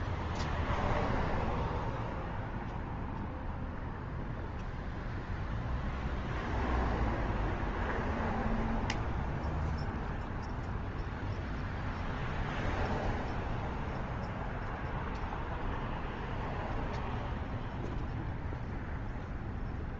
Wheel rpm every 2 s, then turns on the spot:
0, 0, 0, 0, 0, 0, 0, 0, 0, 0.
none